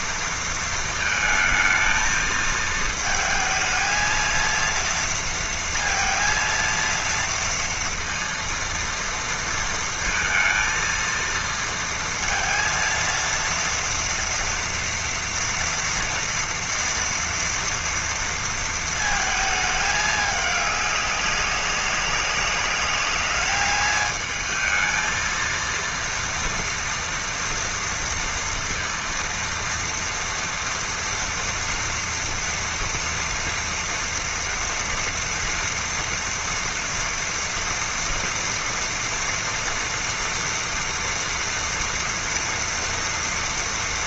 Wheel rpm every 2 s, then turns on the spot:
230, 220, 230, 230, 230, 230, 230, 230, 230, 230, 200, 200, 220, 230, 230, 230, 240, 230, 240, 230, 230, 240.
none